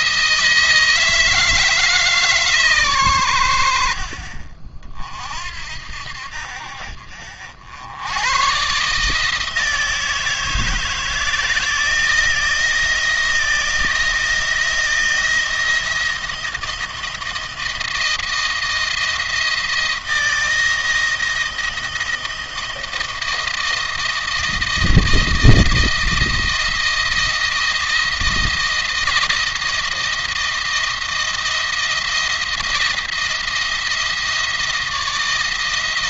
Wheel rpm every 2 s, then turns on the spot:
160, 130, 50, 60, 130, 160, 160, 170, 160, 170, 160, 160, 160, 160, 170, 170, 170, 170.
none